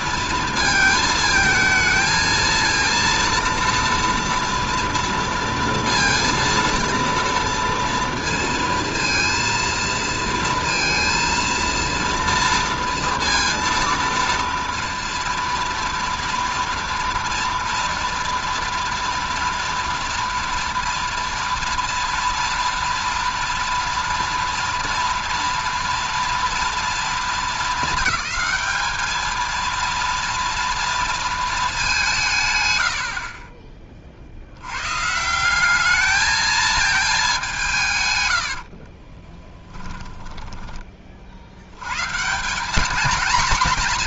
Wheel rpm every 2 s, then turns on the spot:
220, 230, 230, 230, 230, 230, 230, 230, 240, 230, 230, 230, 230, 230, 220, 230, 80, 100, 220, 60, 20, 190.
32-34 38-40